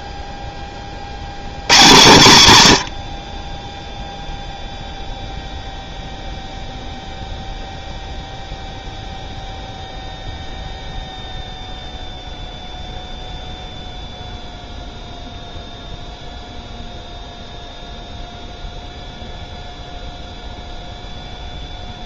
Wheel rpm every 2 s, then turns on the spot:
90, 10, 0, 0, 0, 0, 0, 0, 0, 0, 0.
none